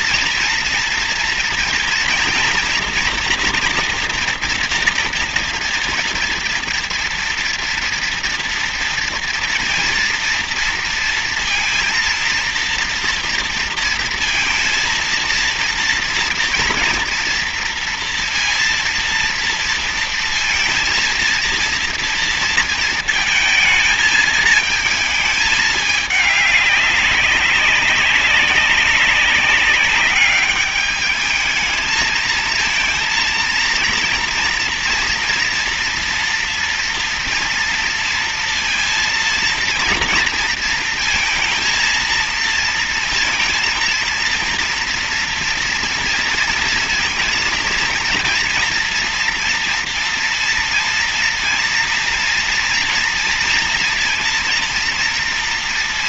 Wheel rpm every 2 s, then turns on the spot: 230, 230, 230, 230, 230, 230, 230, 230, 230, 230, 230, 230, 220, 200, 190, 200, 220, 230, 230, 230, 230, 230, 230, 230, 230, 230, 230, 230.
none